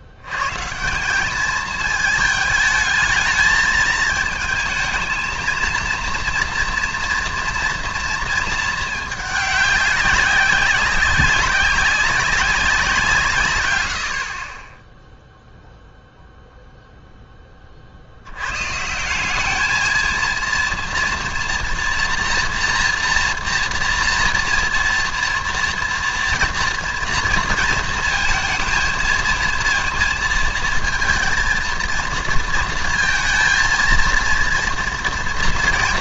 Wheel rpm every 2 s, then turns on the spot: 140, 220, 230, 230, 220, 190, 180, 20, 0, 130, 230, 240, 230, 230, 230, 230, 230, 230.
none